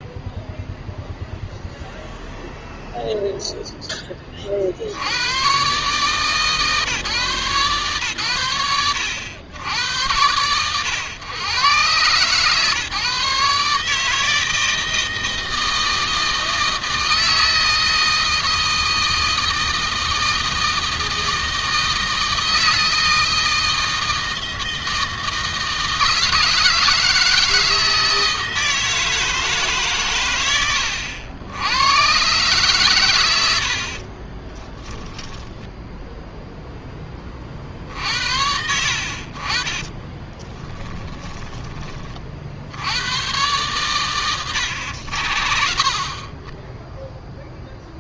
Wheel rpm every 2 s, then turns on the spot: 0, 0, 50, 150, 100, 100, 140, 160, 160, 160, 160, 160, 160, 160, 160, 90, 120, 20, 10, 80, 20, 90, 80, 10.
34-36 40-42